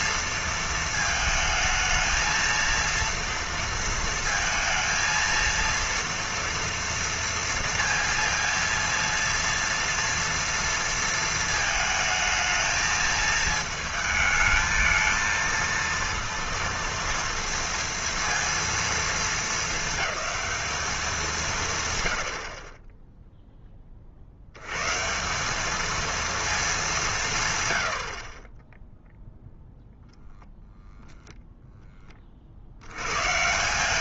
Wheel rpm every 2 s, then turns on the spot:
220, 230, 230, 230, 230, 230, 220, 220, 230, 230, 210, 30, 100, 210, 10, 10, 70.
none